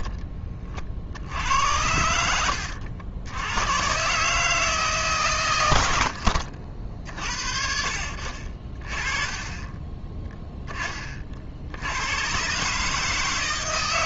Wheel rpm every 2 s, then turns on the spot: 30, 80, 150, 60, 40, 10, 140.
none